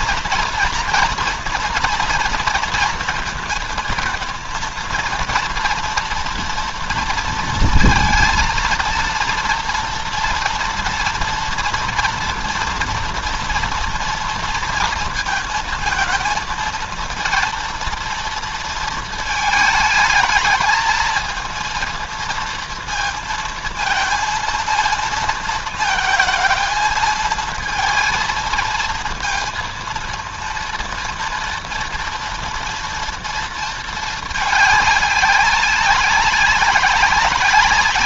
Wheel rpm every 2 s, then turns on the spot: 240, 230, 230, 230, 230, 230, 230, 230, 230, 230, 220, 230, 230, 220, 230, 230, 230, 210, 190.
none